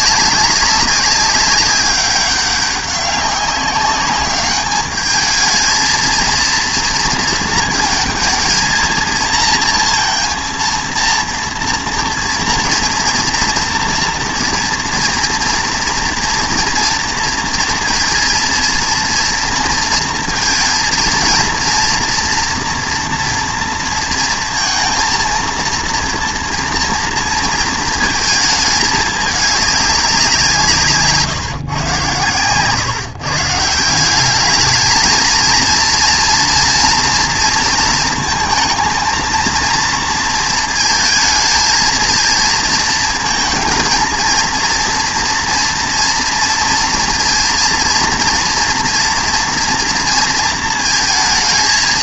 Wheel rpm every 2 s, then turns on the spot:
200, 200, 210, 230, 230, 230, 230, 230, 230, 230, 230, 230, 230, 230, 220, 160, 120, 210, 230, 220, 220, 230, 230, 230, 230, 230.
32-34